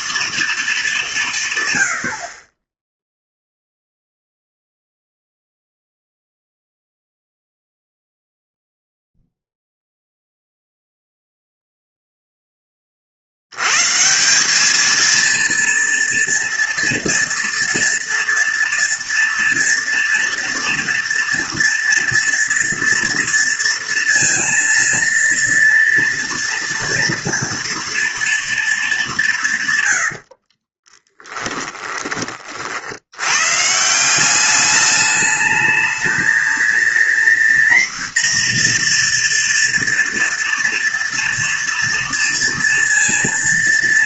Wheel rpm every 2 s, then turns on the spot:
220, 20, 0, 0, 0, 0, 20, 200, 230, 230, 230, 230, 230, 230, 220, 30, 50, 200, 230, 240, 230, 230.
30-32